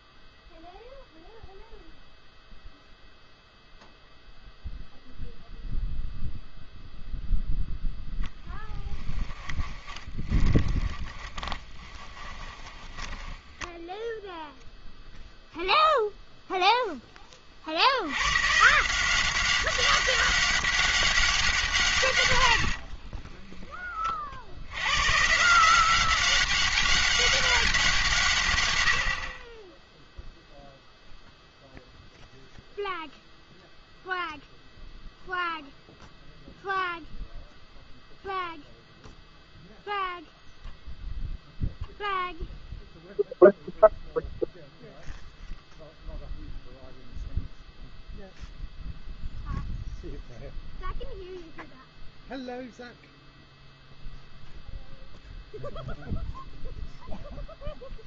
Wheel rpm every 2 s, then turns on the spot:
0, 0, 0, 0, 10, 20, 20, 0, 0, 150, 200, 80, 80, 200, 130, 0, 0, 0, 0, 0, 0, 0, 0, 0, 0, 0, 0, 0, 0.
8-14 22-24